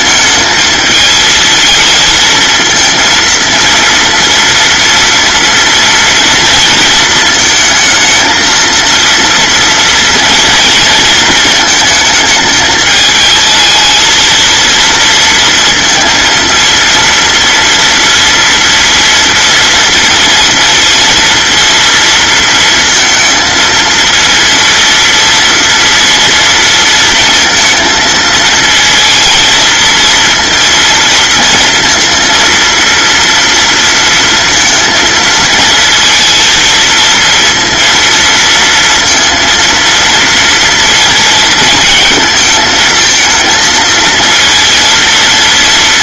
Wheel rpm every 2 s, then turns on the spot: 220, 230, 230, 220, 230, 230, 220, 230, 230, 230, 230, 230, 230, 230, 220, 230, 230, 230, 230, 230, 230, 220, 230.
none